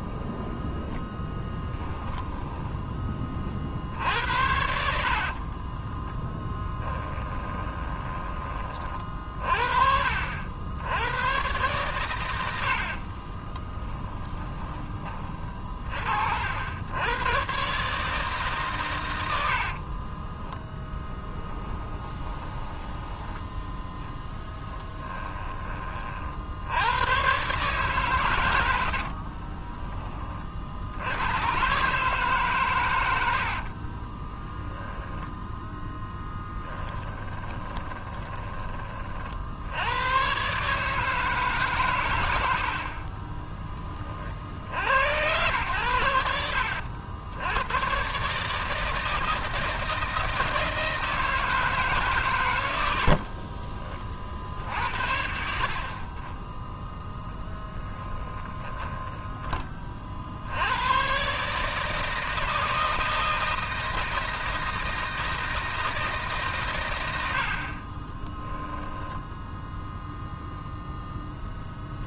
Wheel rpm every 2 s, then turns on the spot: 10, 10, 70, 10, 30, 80, 70, 20, 70, 140, 10, 10, 10, 80, 100, 60, 120, 10, 20, 30, 140, 60, 70, 80, 160, 160, 90, 60, 0, 10, 90, 160, 160, 130, 10, 0.
2-8 20-26 34-38 42-44 58-60 68-70